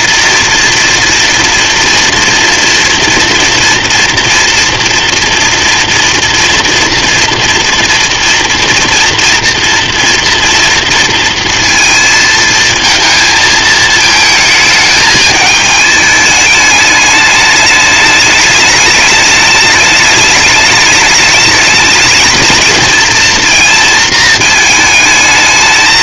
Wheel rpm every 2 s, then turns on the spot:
230, 230, 230, 230, 230, 230, 220, 220, 210, 210, 210, 220, 220.
none